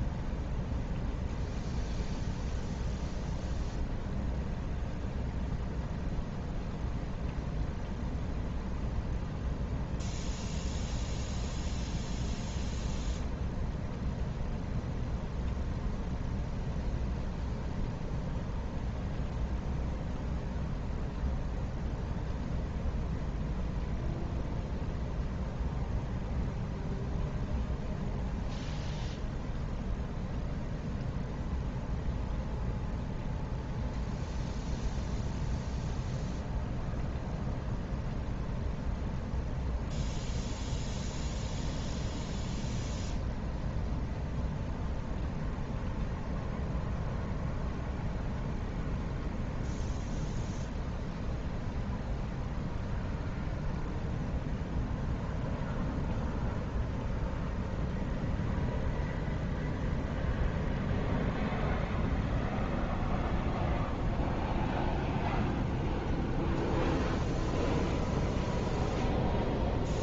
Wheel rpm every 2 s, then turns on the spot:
0, 0, 0, 0, 0, 0, 0, 0, 0, 0, 0, 0, 0, 0, 0, 0, 0, 0, 0, 0, 0, 0, 0, 0, 0, 0, 0, 0, 0, 0, 0, 0, 0, 0, 0.
none